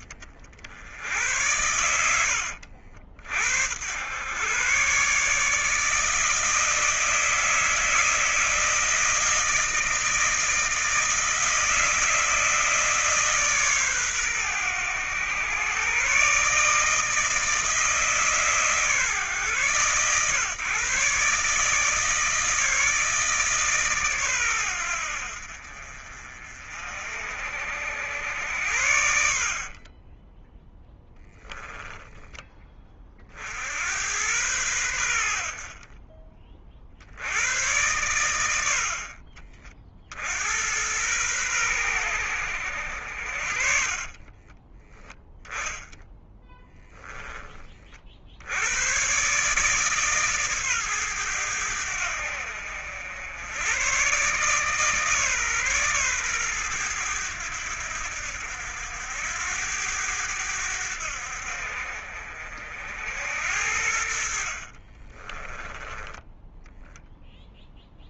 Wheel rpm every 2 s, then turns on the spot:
60, 80, 120, 160, 160, 160, 160, 120, 140, 140, 120, 160, 110, 50, 80, 20, 20, 100, 40, 100, 80, 80, 10, 0, 70, 140, 70, 140, 120, 80, 90, 60, 50, 10.
28-30 38-40 44-46 64-66